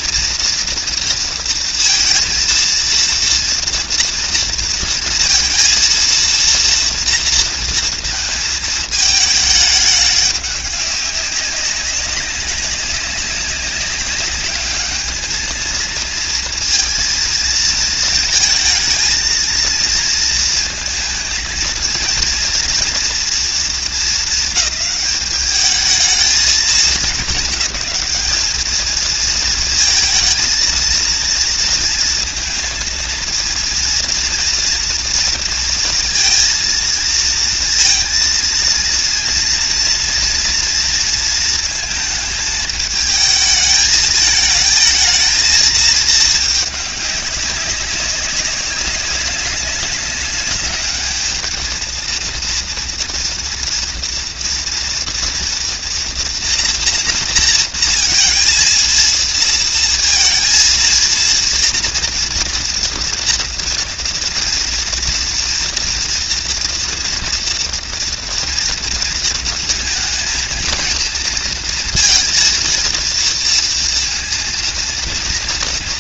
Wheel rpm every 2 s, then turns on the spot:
230, 230, 230, 230, 220, 200, 200, 210, 230, 220, 230, 230, 210, 220, 220, 230, 230, 230, 230, 230, 230, 220, 220, 210, 190, 210, 230, 230, 230, 230, 230, 230, 230, 230, 230, 230, 230, 230.
none